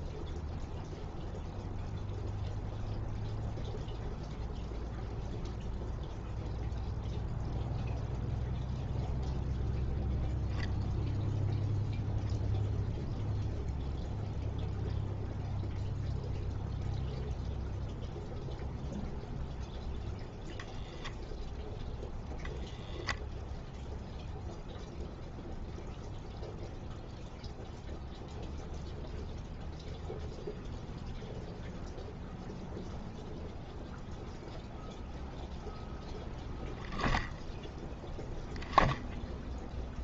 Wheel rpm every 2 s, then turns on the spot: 0, 0, 0, 0, 0, 0, 0, 0, 0, 0, 0, 0, 0, 0, 0, 0, 0, 0, 0, 10.
none